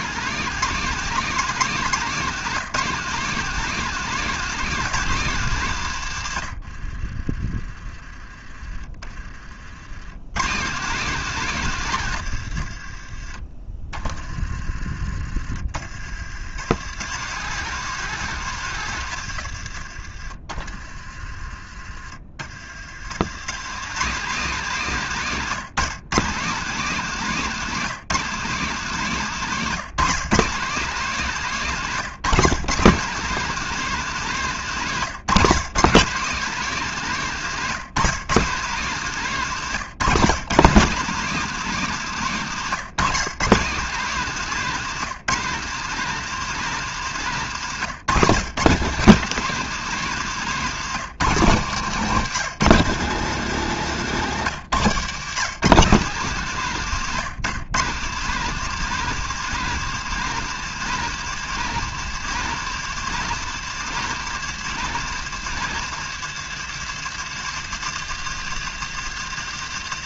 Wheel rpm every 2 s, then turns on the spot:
210, 200, 210, 60, 30, 150, 70, 40, 120, 130, 40, 80, 180, 180, 180, 190, 180, 160, 190, 170, 180, 150, 190, 180, 170, 180, 190, 140, 160, 190, 200, 190, 190, 160, 160.
6-8